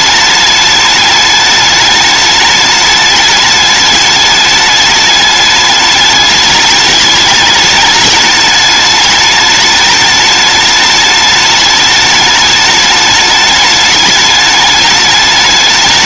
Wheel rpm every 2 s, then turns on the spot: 210, 210, 210, 210, 210, 210, 210, 210.
none